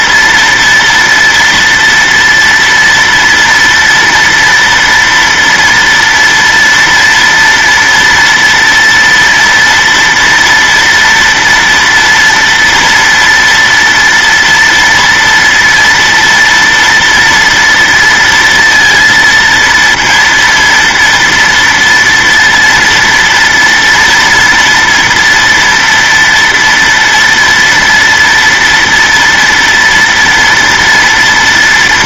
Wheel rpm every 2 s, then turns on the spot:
230, 230, 230, 230, 230, 240, 230, 230, 240, 230, 230, 230, 230, 230, 230, 230.
none